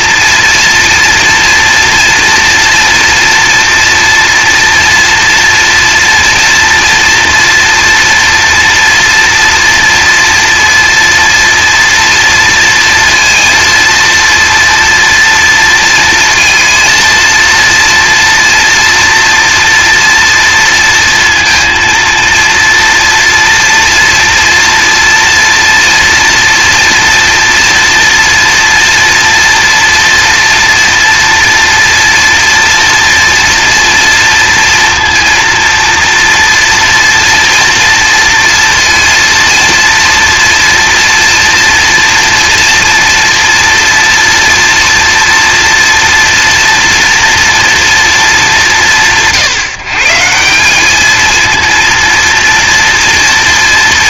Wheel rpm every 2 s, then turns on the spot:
230, 230, 230, 240, 230, 230, 230, 240, 230, 230, 230, 230, 230, 230, 230, 230, 230, 230, 240, 230, 230, 230, 230, 230, 200, 190, 230.
none